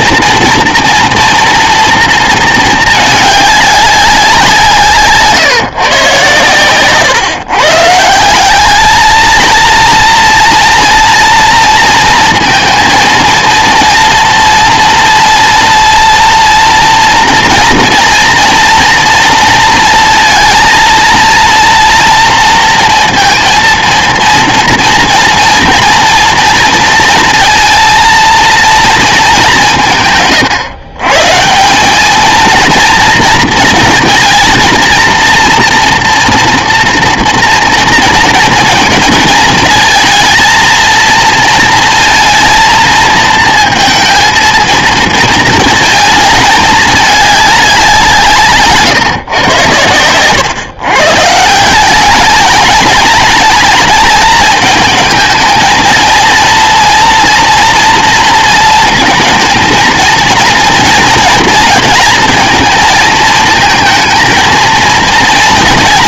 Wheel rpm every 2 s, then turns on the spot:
240, 220, 170, 120, 200, 230, 230, 230, 230, 230, 230, 230, 230, 230, 230, 130, 230, 220, 240, 230, 230, 220, 230, 210, 160, 130, 220, 220, 230, 230, 230, 230, 230.
none